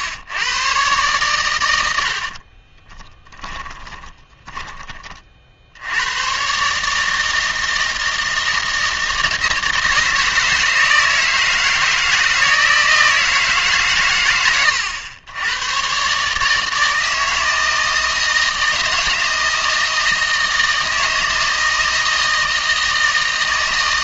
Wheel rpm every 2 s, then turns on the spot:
120, 20, 20, 140, 160, 160, 160, 100, 160, 160, 160, 160.
2-4